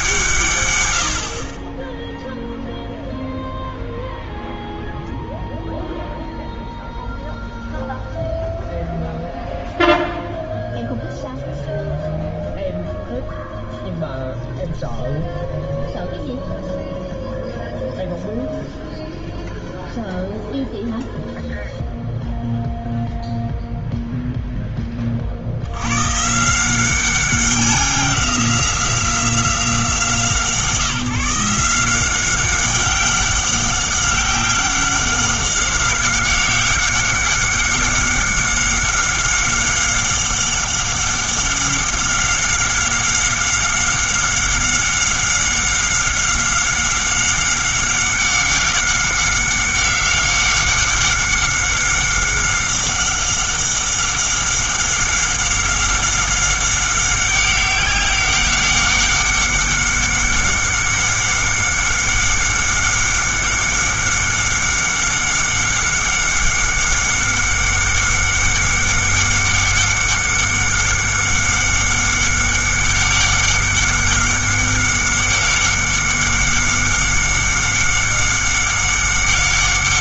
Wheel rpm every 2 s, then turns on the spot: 110, 0, 0, 0, 0, 0, 0, 0, 0, 0, 0, 0, 10, 170, 180, 160, 190, 190, 190, 190, 190, 190, 190, 190, 190, 190, 190, 190, 190, 190, 190, 200, 190, 190, 190, 190, 190, 190, 190, 190.
none